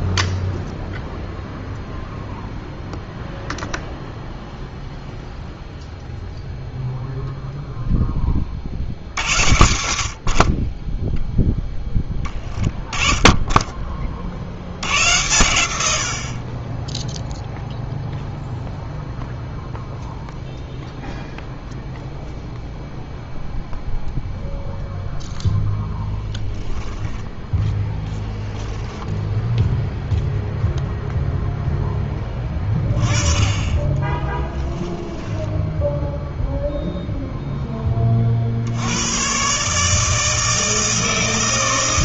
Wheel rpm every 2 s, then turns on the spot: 0, 0, 0, 0, 50, 30, 20, 90, 10, 0, 0, 0, 0, 10, 10, 0, 20, 10, 0, 80, 160.
26-30 34-36